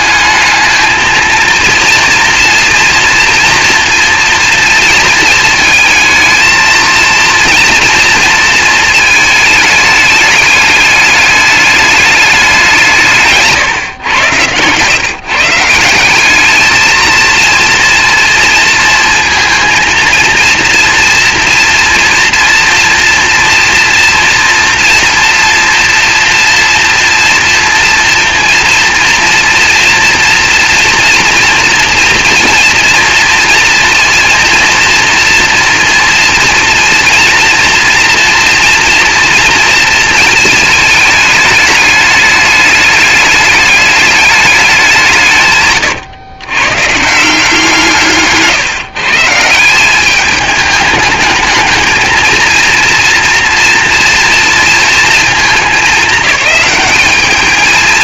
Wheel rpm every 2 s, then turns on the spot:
220, 230, 230, 230, 220, 210, 160, 140, 220, 230, 230, 230, 230, 230, 230, 240, 230, 230, 230, 230, 210, 210, 180, 150, 140, 210, 230, 230, 210.
none